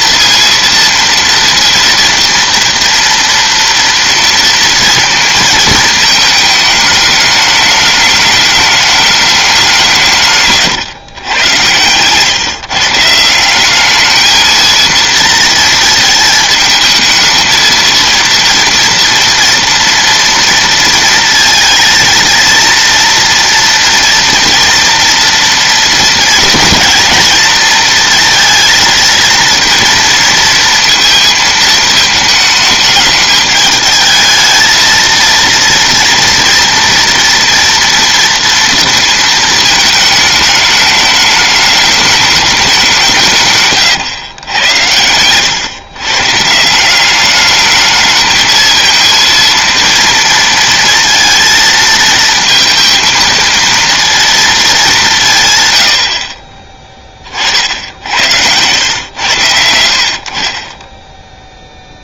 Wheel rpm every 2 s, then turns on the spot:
230, 230, 230, 220, 210, 130, 150, 220, 220, 230, 230, 230, 230, 230, 230, 230, 220, 220, 230, 230, 210, 200, 100, 160, 220, 230, 230, 220, 30, 100, 30.
10-12 60-62